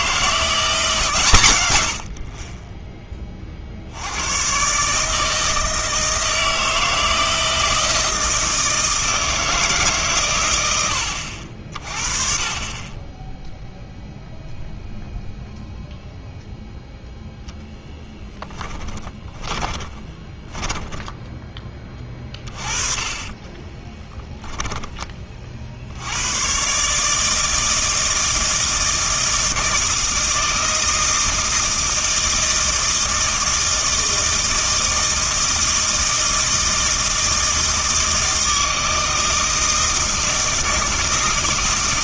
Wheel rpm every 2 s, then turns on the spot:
170, 20, 130, 160, 160, 100, 30, 0, 0, 20, 10, 30, 10, 130, 160, 160, 160, 160, 160, 160, 160.
18-24